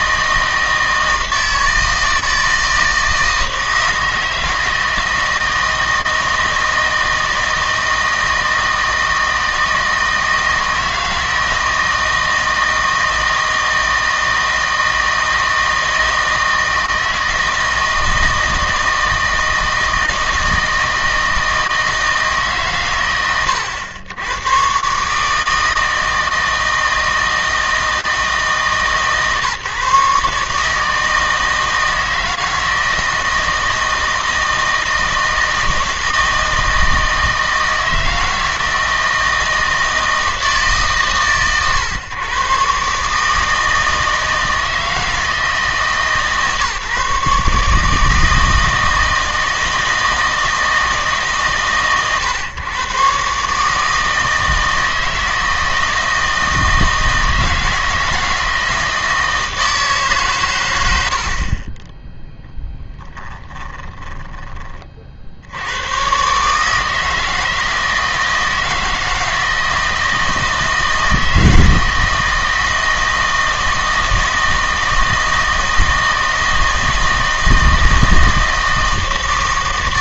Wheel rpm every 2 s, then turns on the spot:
160, 160, 160, 160, 160, 160, 160, 160, 160, 160, 160, 130, 120, 160, 150, 150, 160, 160, 160, 160, 160, 140, 160, 150, 160, 160, 120, 160, 160, 160, 100, 10, 30, 150, 160, 160, 160, 160, 160, 160.
none